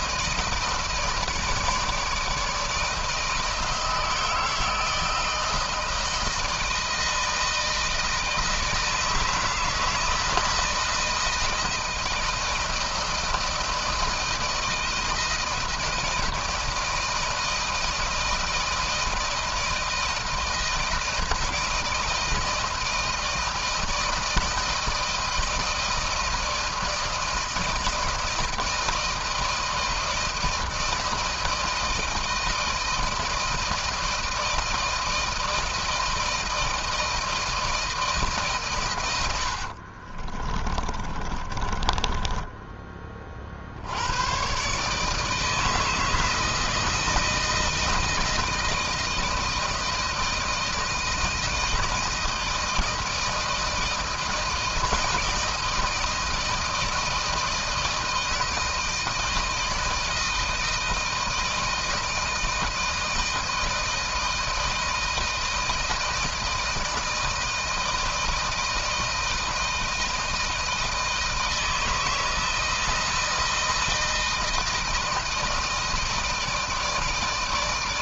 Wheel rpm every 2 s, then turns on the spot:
160, 160, 160, 160, 160, 160, 160, 160, 160, 160, 160, 160, 160, 160, 160, 160, 160, 160, 160, 120, 30, 20, 130, 160, 160, 160, 160, 160, 160, 160, 160, 160, 160, 160, 160, 160, 160, 160, 160.
40-42